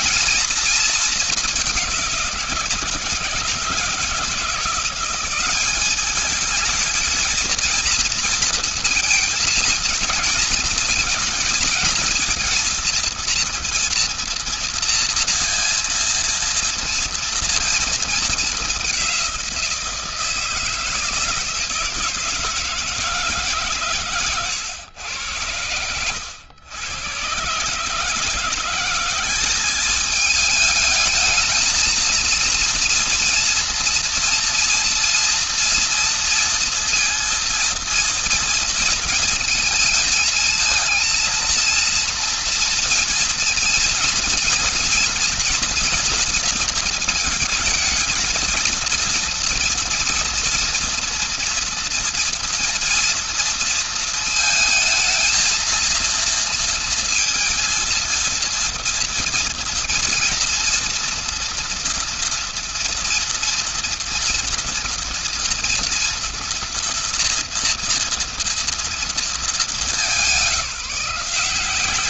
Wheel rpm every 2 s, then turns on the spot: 230, 180, 170, 210, 230, 210, 220, 230, 230, 220, 160, 160, 120, 110, 170, 210, 230, 230, 230, 230, 220, 230, 230, 230, 230, 230, 230, 230, 230, 230, 230, 230, 240, 230, 230, 190.
none